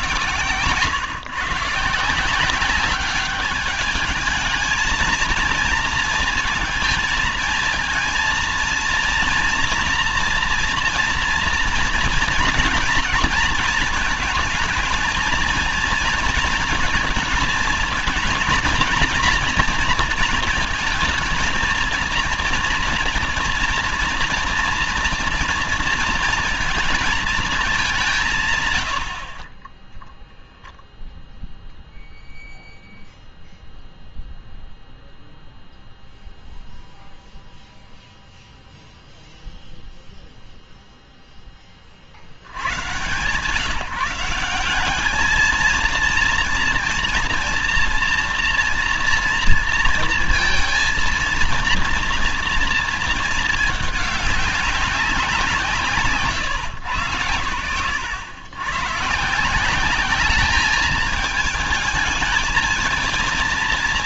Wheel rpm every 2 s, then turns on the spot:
130, 180, 220, 220, 230, 240, 230, 220, 230, 230, 230, 230, 240, 230, 130, 0, 0, 0, 0, 0, 0, 90, 190, 230, 230, 230, 230, 200, 110, 110, 210, 230.
none